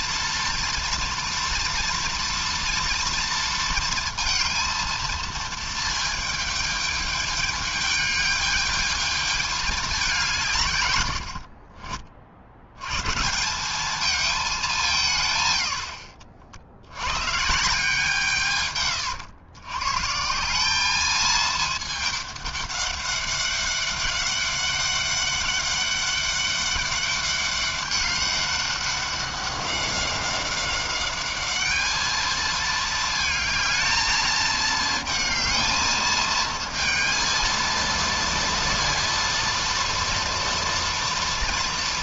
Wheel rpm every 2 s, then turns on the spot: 230, 240, 230, 220, 210, 160, 90, 210, 80, 140, 180, 210, 200, 200, 200, 190, 220, 220, 220, 230, 230.
none